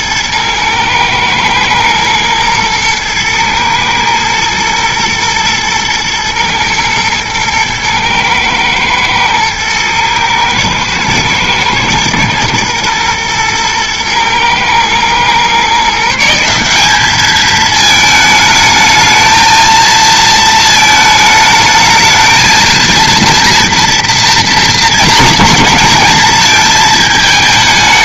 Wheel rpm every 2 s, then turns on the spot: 110, 110, 120, 110, 110, 110, 110, 120, 200, 220, 220, 230, 220, 220.
none